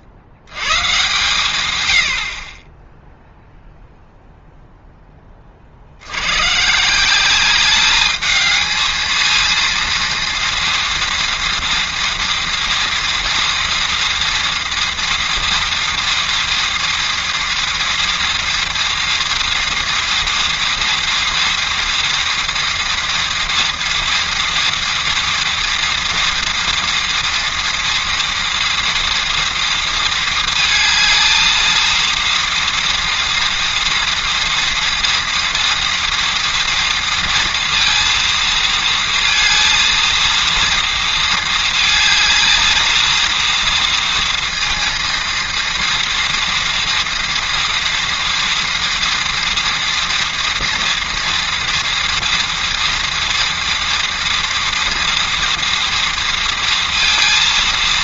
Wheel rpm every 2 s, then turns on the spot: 40, 40, 0, 140, 220, 230, 230, 230, 230, 230, 240, 230, 230, 230, 230, 220, 240, 230, 230, 230, 230, 220, 230, 230, 230, 230, 230, 230, 230.
none